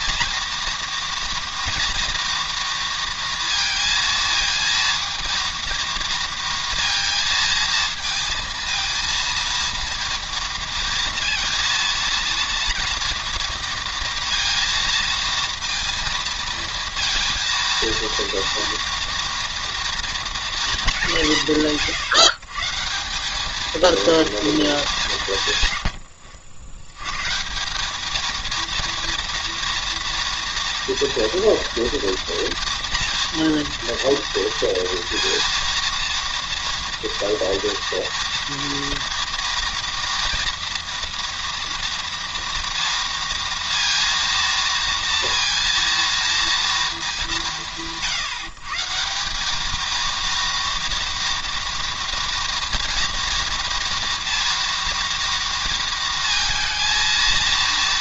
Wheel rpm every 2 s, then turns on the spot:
230, 230, 230, 230, 230, 230, 230, 230, 230, 230, 220, 160, 210, 100, 230, 230, 230, 230, 230, 230, 240, 230, 230, 220, 160, 230, 240, 230, 230.
none